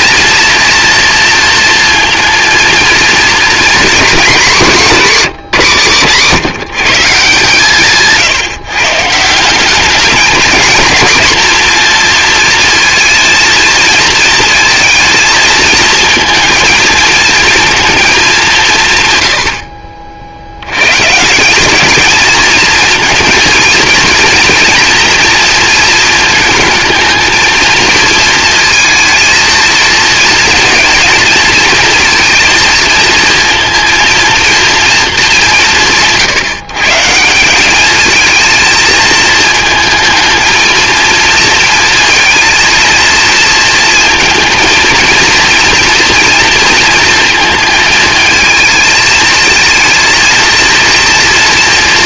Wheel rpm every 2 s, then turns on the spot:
230, 230, 210, 160, 150, 220, 230, 220, 230, 160, 110, 230, 230, 220, 220, 220, 230, 230, 150, 230, 230, 220, 230, 230, 220, 230.
none